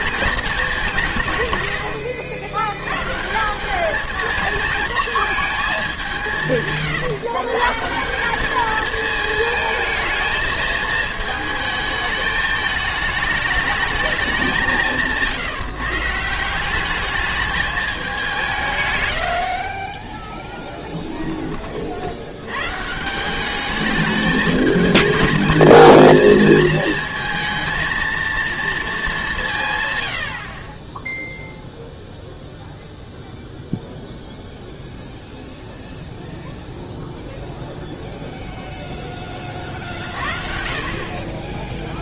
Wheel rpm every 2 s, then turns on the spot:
200, 100, 230, 140, 210, 220, 210, 180, 190, 140, 10, 120, 210, 220, 230, 40, 0, 0, 0, 0, 50.
20-22